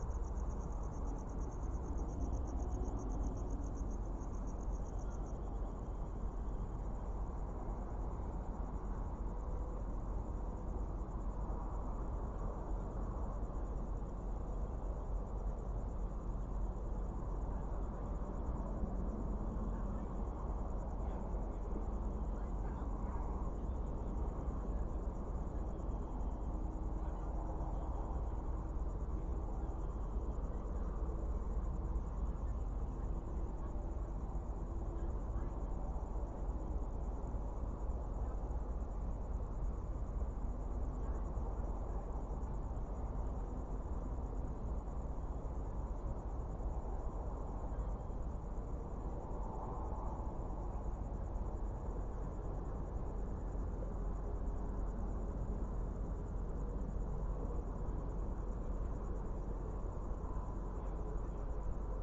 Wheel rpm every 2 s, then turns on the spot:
0, 0, 0, 0, 0, 0, 0, 0, 0, 0, 0, 0, 0, 0, 0, 0, 0, 0, 0, 0, 0, 0, 0, 0, 0, 0, 0, 0, 0, 0, 0.
none